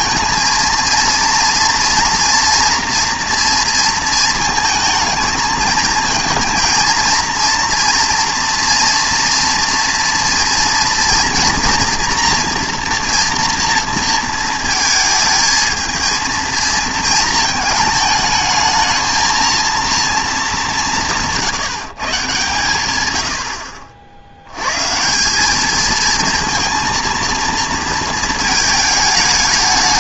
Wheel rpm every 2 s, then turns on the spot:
230, 230, 230, 230, 230, 240, 240, 220, 230, 220, 200, 130, 100, 230, 220.
none